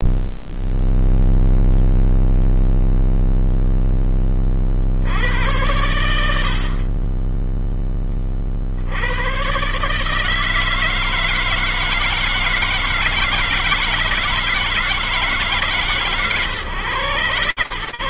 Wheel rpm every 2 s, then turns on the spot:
0, 0, 0, 100, 10, 120, 160, 160, 160.
none